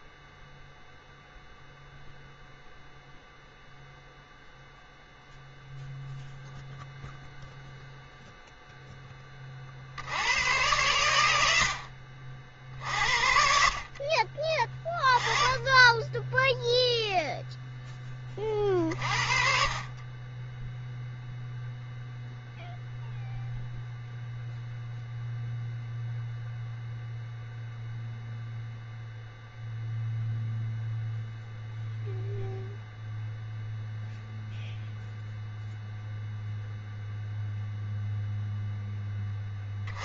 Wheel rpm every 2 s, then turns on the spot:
0, 0, 0, 0, 0, 100, 50, 20, 0, 40, 10, 0, 0, 0, 0, 0, 0, 0, 0, 0.
none